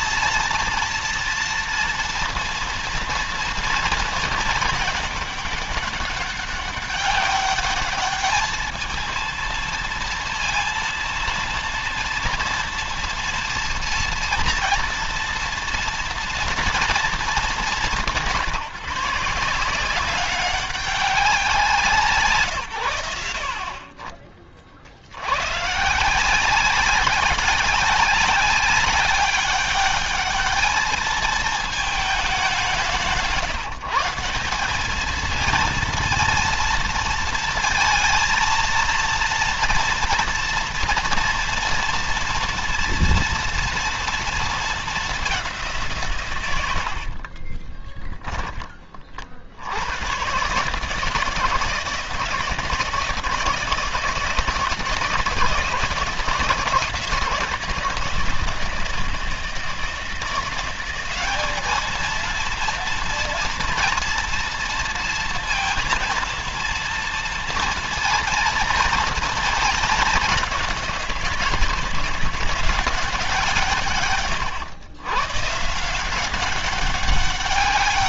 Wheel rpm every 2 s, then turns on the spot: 230, 230, 210, 200, 220, 230, 230, 230, 230, 160, 190, 120, 60, 190, 190, 220, 170, 200, 230, 230, 230, 230, 220, 80, 30, 150, 160, 160, 160, 160, 180, 230, 230, 230, 220, 180, 180, 120, 190.
none